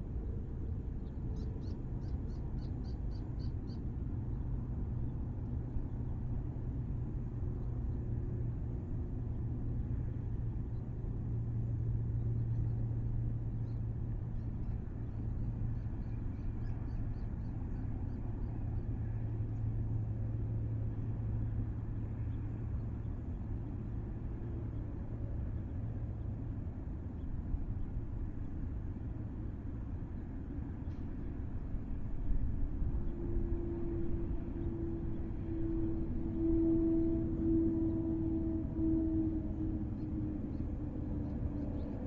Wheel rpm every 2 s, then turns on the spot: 0, 0, 0, 0, 0, 0, 0, 0, 0, 0, 0, 0, 0, 0, 0, 0, 0, 0, 0, 0, 0.
none